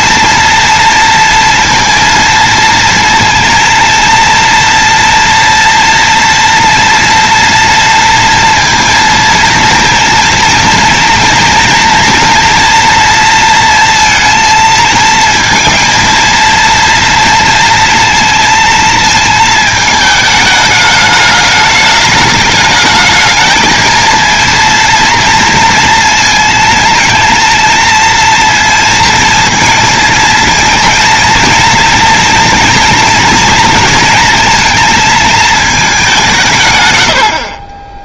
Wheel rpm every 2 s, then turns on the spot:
230, 230, 230, 230, 230, 230, 230, 220, 230, 230, 220, 220, 230, 230, 230, 230, 230, 230, 100.
none